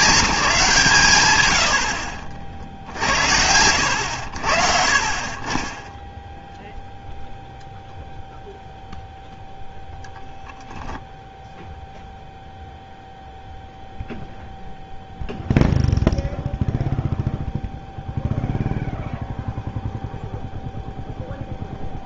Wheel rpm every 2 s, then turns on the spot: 190, 60, 70, 0, 0, 10, 0, 0, 0, 0, 0.
none